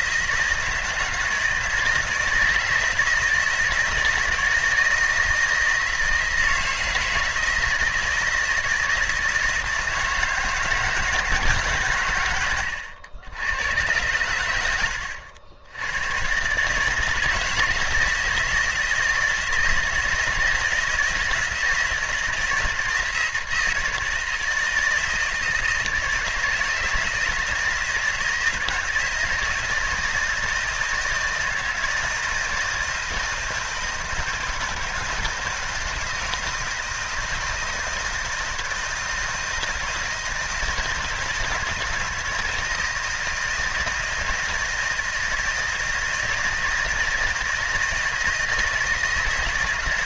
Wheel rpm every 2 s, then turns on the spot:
160, 160, 160, 160, 160, 160, 100, 80, 160, 160, 160, 160, 160, 160, 160, 160, 160, 160, 160, 160, 160, 160, 160, 160, 160.
12-14